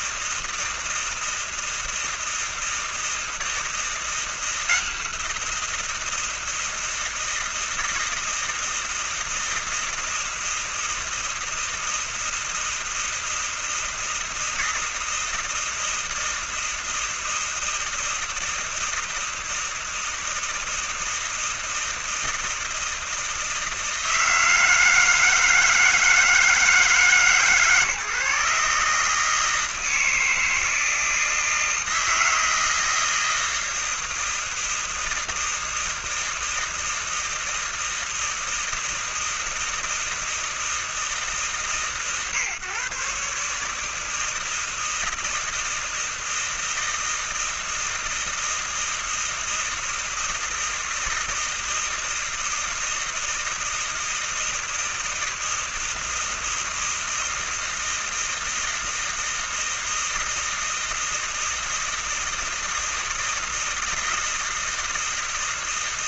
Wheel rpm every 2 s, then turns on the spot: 160, 160, 170, 160, 160, 160, 160, 160, 160, 160, 160, 160, 160, 160, 150, 160, 160, 160, 160, 160, 160, 140, 160, 160, 160, 160, 160, 160, 160, 160, 160, 160, 160.
none